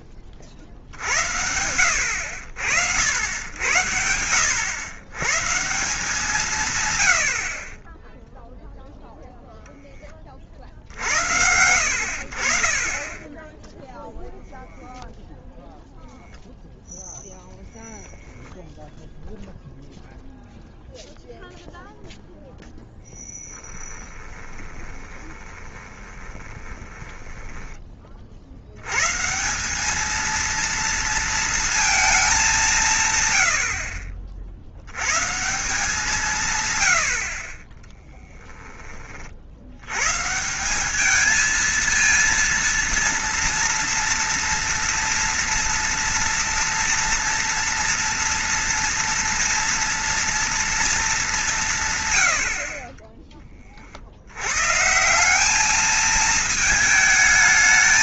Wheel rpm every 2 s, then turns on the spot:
40, 70, 90, 140, 0, 60, 40, 0, 0, 10, 0, 0, 20, 20, 80, 230, 200, 60, 120, 10, 180, 230, 230, 230, 230, 230, 50, 120, 220.
24-28